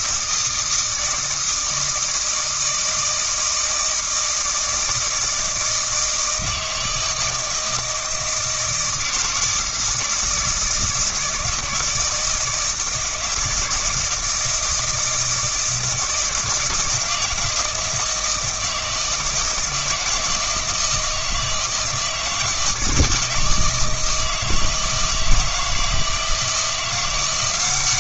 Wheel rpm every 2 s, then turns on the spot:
160, 160, 160, 160, 160, 160, 160, 160, 160, 160, 160, 160, 160, 170.
none